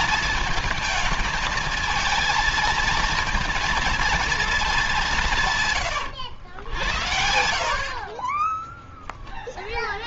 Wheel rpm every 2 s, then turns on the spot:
220, 230, 220, 80, 10.
none